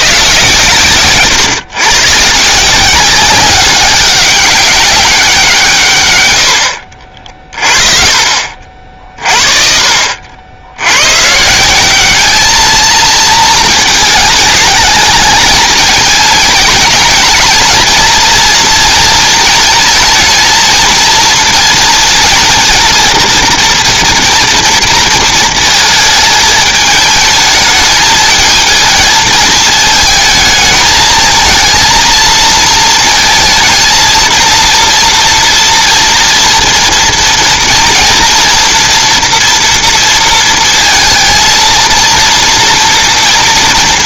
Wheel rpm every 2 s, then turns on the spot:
140, 180, 200, 60, 50, 80, 220, 210, 220, 230, 230, 230, 230, 210, 230, 220, 230, 230, 230, 230, 230, 230.
none